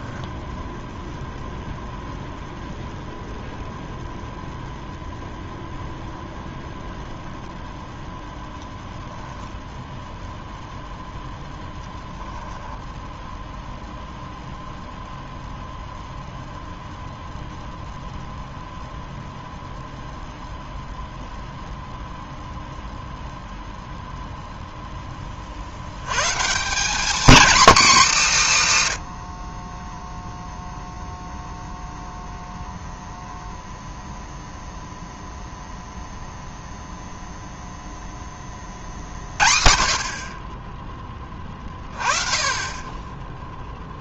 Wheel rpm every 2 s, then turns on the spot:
0, 0, 0, 0, 0, 0, 0, 0, 0, 0, 0, 0, 0, 180, 140, 0, 0, 0, 0, 40, 20, 20.
none